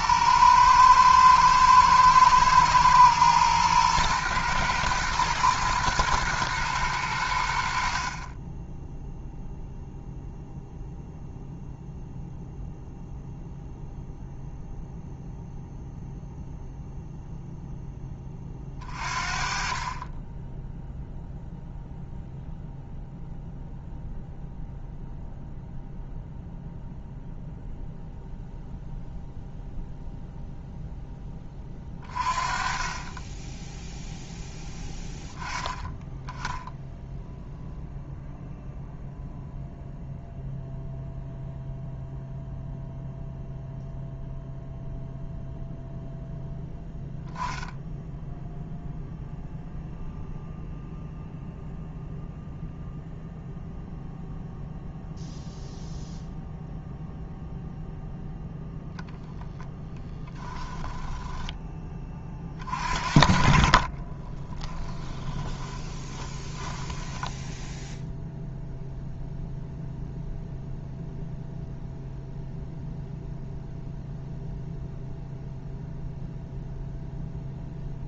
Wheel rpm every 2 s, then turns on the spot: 110, 110, 120, 110, 10, 0, 0, 0, 0, 30, 0, 0, 0, 0, 0, 0, 20, 10, 0, 0, 0, 0, 0, 0, 0, 0, 0, 0, 0, 0, 10, 40, 10, 10, 0, 0, 0, 0, 0.
60-62 64-68